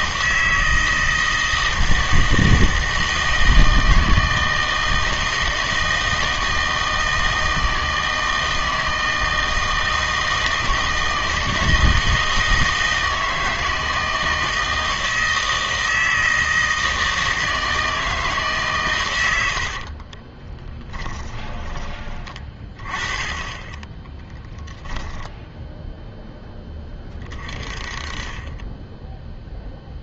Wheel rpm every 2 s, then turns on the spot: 160, 160, 160, 160, 160, 160, 160, 160, 160, 140, 10, 30, 20, 10, 20.
20-22 24-26